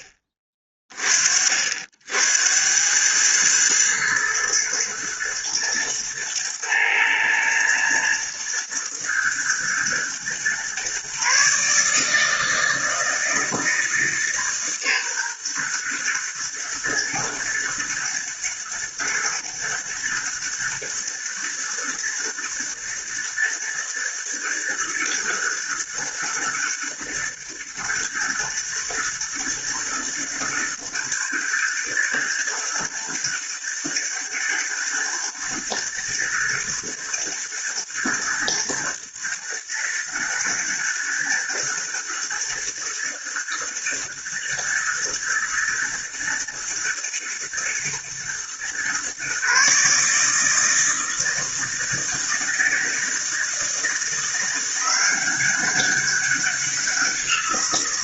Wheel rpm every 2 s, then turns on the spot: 30, 100, 110, 110, 110, 130, 160, 130, 120, 110, 110, 120, 120, 120, 110, 110, 110, 120, 110, 110, 110, 110, 120, 120, 130, 160, 160, 180, 180.
none